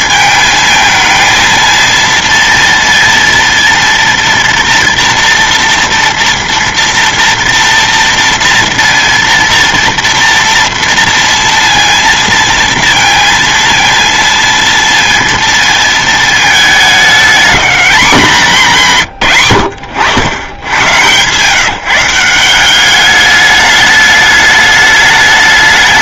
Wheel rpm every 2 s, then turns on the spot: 220, 230, 230, 230, 230, 230, 230, 230, 210, 170, 100, 190, 210.
none